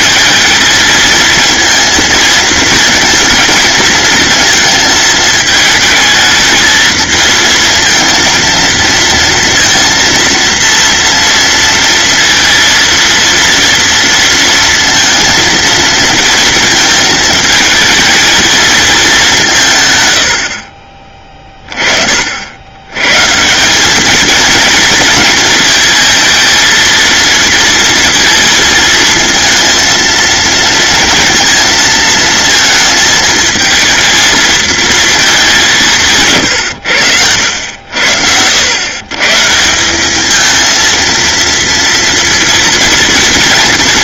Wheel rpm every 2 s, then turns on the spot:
220, 220, 220, 220, 230, 230, 230, 230, 220, 220, 40, 110, 230, 230, 230, 230, 220, 230, 110, 110, 220, 230.
none